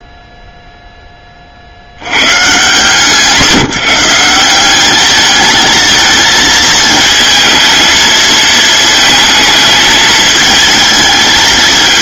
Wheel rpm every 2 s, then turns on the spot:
0, 140, 200, 230, 220, 220.
none